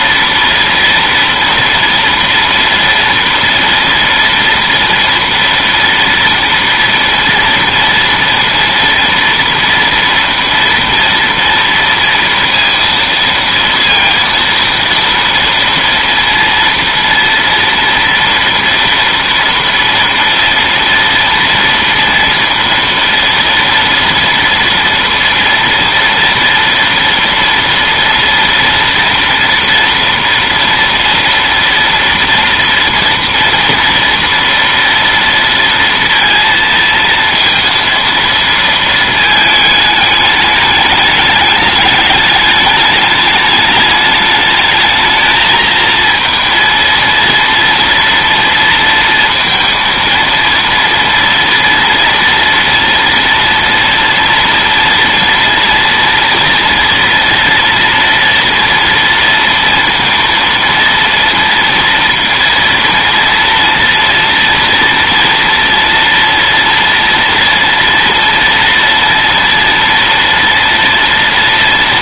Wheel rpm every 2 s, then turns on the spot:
230, 230, 230, 230, 230, 230, 230, 230, 230, 230, 230, 230, 230, 240, 230, 230, 230, 230, 230, 230, 210, 210, 220, 230, 230, 230, 230, 240, 230, 230, 230, 230, 230, 230, 230, 230.
none